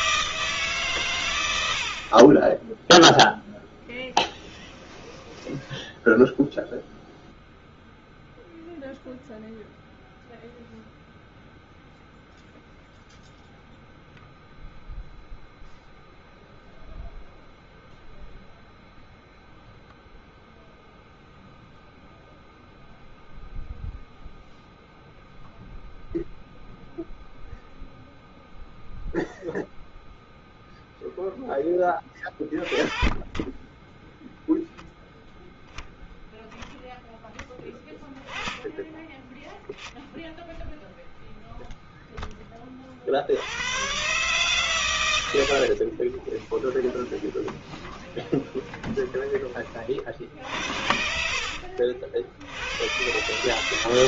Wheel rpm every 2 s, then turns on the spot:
160, 30, 10, 0, 0, 0, 0, 0, 0, 0, 0, 0, 0, 0, 0, 0, 40, 0, 0, 10, 0, 10, 130, 30, 20, 50, 80.
4-6 46-50